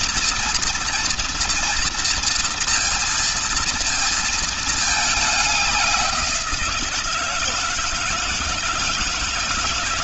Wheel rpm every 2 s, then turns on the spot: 230, 230, 220, 170, 160.
none